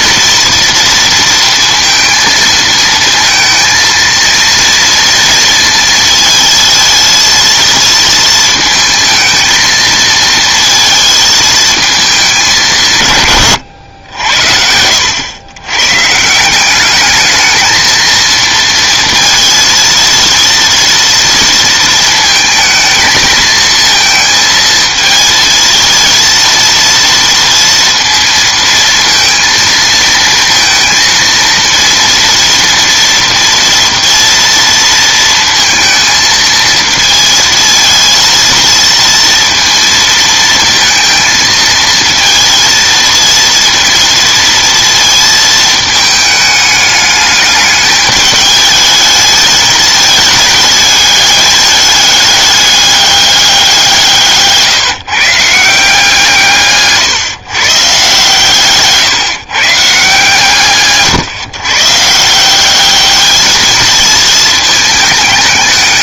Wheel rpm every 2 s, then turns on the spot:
230, 230, 230, 230, 230, 230, 170, 80, 180, 230, 230, 220, 220, 230, 230, 230, 230, 230, 230, 230, 230, 230, 230, 210, 210, 210, 210, 160, 140, 160, 150, 190, 220.
none